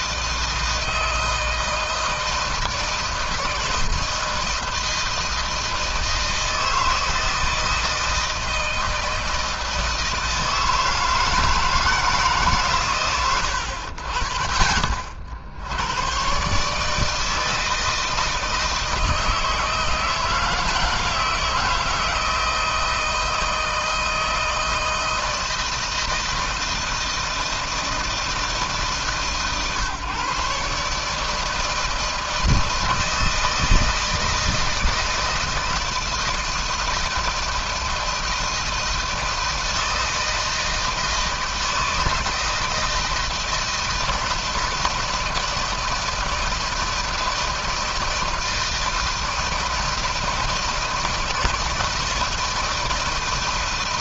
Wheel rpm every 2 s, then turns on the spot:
160, 160, 160, 160, 160, 160, 120, 50, 150, 160, 160, 160, 160, 160, 150, 150, 160, 160, 160, 160, 160, 160, 160, 160, 160, 160, 160.
none